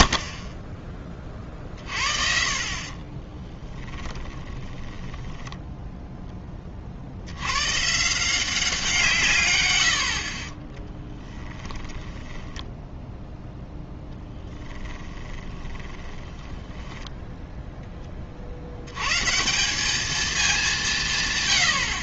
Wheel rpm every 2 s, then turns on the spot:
90, 50, 20, 20, 170, 30, 10, 10, 20, 60, 200.
4-6 10-18